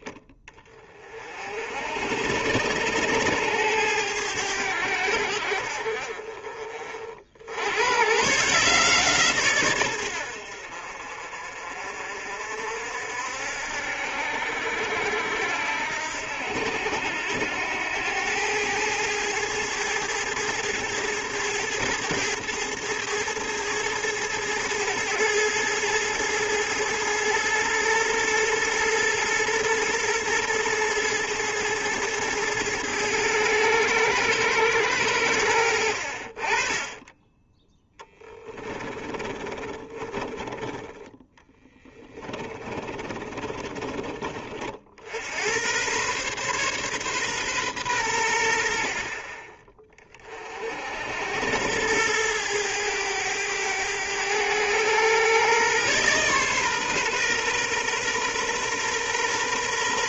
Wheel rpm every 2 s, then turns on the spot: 30, 90, 90, 40, 150, 60, 60, 70, 90, 110, 110, 110, 110, 110, 110, 110, 110, 100, 30, 10, 10, 30, 60, 130, 50, 60, 100, 110, 130, 120.
38-40 42-44